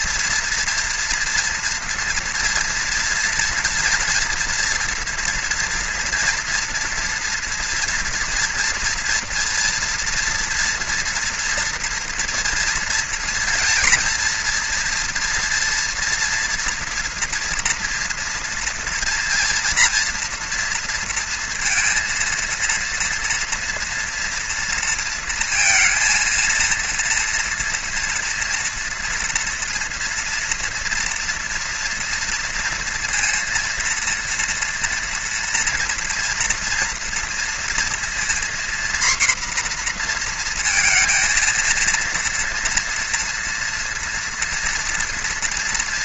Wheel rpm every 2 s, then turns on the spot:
230, 230, 230, 230, 240, 230, 230, 240, 230, 230, 230, 230, 230, 230, 230, 230, 230, 230, 230, 240, 230, 230, 230.
none